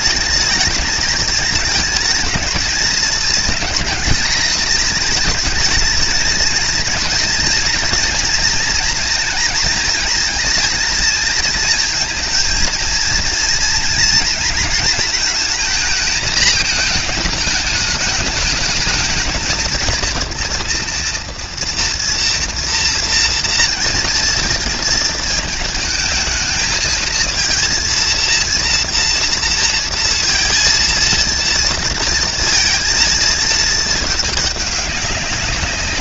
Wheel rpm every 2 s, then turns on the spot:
210, 220, 220, 220, 230, 220, 230, 230, 220, 210, 230, 240, 230, 220, 230, 230, 230, 210.
none